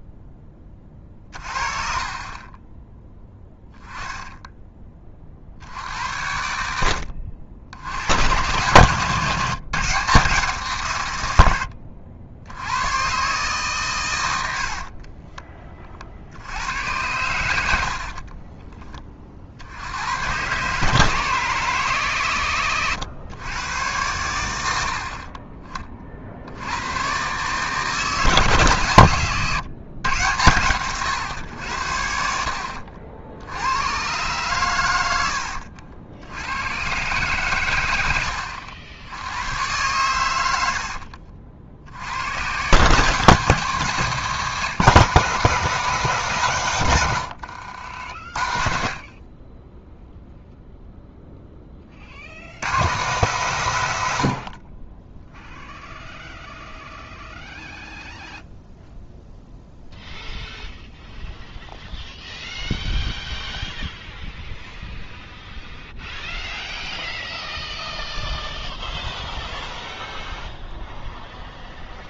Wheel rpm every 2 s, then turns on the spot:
30, 20, 10, 70, 120, 150, 90, 70, 80, 20, 130, 120, 80, 90, 140, 110, 60, 120, 110, 80, 80, 120, 180, 140, 50, 0, 90, 60, 0, 0, 0, 0, 0, 0, 0, 0.
14-16 18-20 32-34